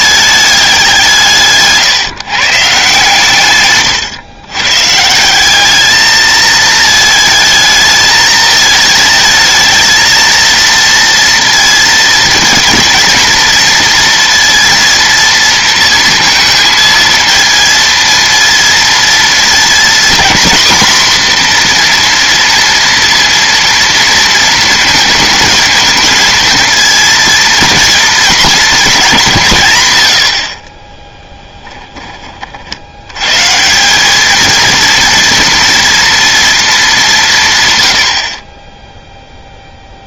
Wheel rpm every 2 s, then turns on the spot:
190, 150, 130, 220, 220, 230, 220, 230, 230, 230, 240, 230, 220, 230, 220, 30, 60, 220, 220, 20.
none